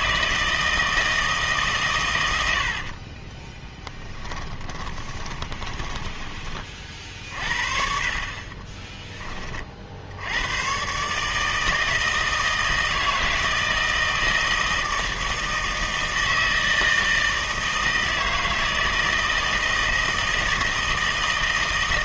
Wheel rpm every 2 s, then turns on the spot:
160, 70, 20, 30, 20, 110, 160, 160, 160, 160, 160.
2-6 8-10